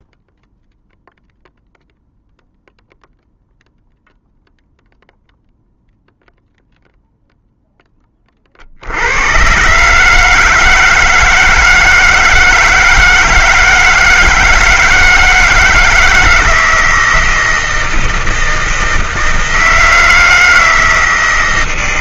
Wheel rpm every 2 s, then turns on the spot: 0, 0, 0, 0, 40, 160, 160, 160, 160, 160, 160.
none